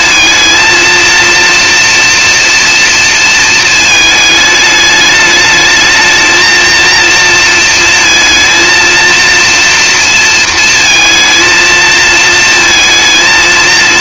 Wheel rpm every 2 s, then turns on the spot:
230, 230, 210, 230, 230, 230, 230.
none